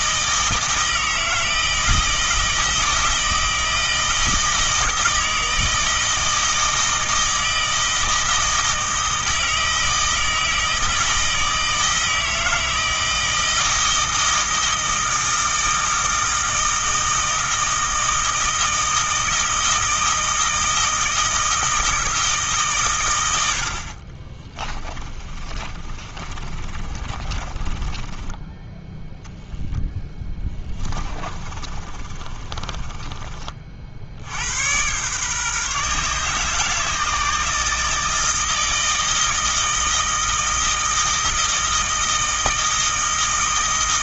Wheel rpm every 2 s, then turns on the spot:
160, 160, 160, 160, 160, 160, 160, 160, 160, 160, 160, 130, 20, 30, 10, 20, 30, 110, 160, 160, 160, 160.
24-34